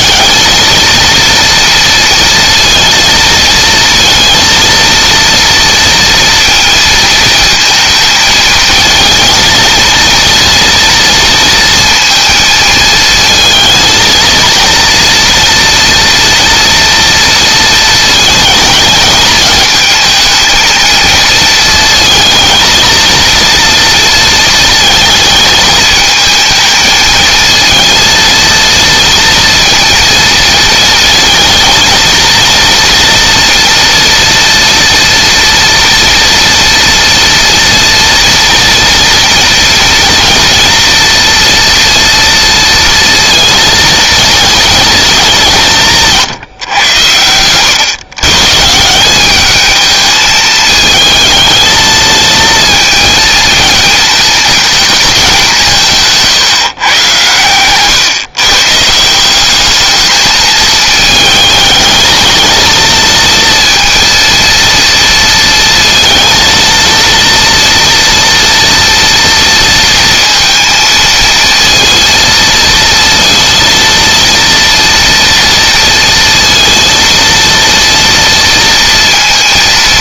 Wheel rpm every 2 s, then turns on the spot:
220, 230, 230, 230, 220, 230, 230, 230, 230, 220, 230, 230, 220, 220, 230, 220, 230, 230, 230, 230, 230, 230, 220, 120, 160, 220, 230, 230, 140, 140, 220, 230, 230, 230, 230, 230, 230, 230, 230, 230.
none